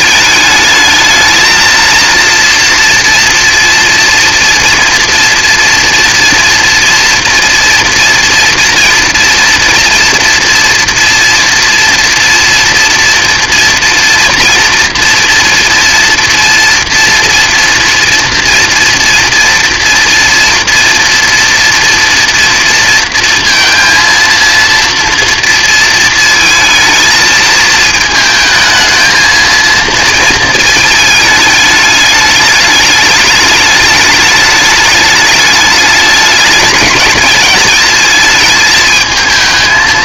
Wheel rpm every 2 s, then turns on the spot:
220, 230, 230, 230, 230, 230, 230, 230, 240, 240, 230, 230, 230, 230, 220, 220, 210, 210, 200, 220.
none